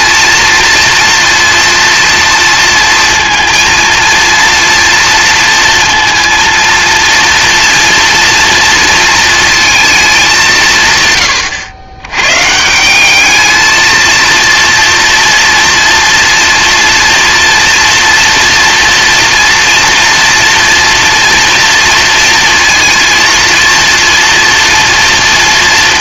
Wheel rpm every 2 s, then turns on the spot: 230, 230, 230, 230, 230, 170, 160, 230, 230, 230, 230, 230, 230.
none